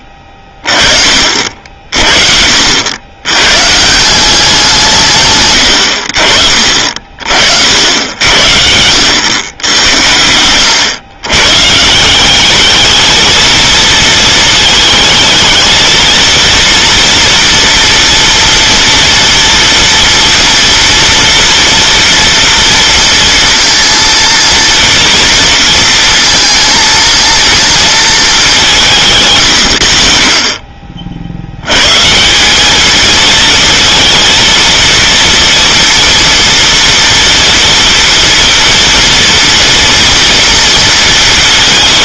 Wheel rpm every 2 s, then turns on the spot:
30, 70, 180, 40, 70, 90, 210, 220, 230, 230, 230, 230, 230, 230, 190, 40, 190, 230, 230, 230, 230.
none